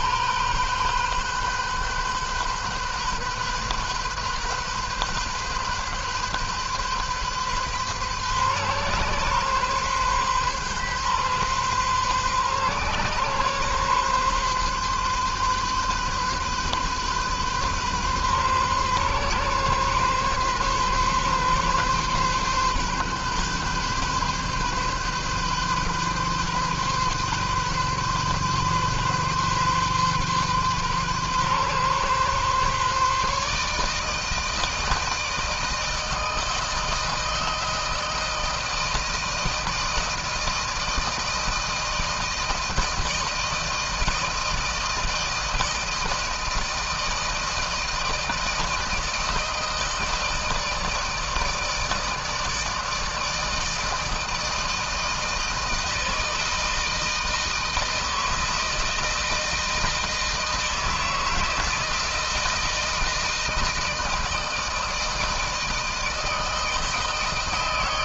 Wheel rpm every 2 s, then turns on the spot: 130, 130, 130, 130, 130, 130, 130, 130, 130, 130, 140, 130, 130, 130, 130, 130, 140, 160, 160, 160, 160, 160, 160, 160, 160, 160, 160, 160, 160, 160, 160, 160, 160, 160.
none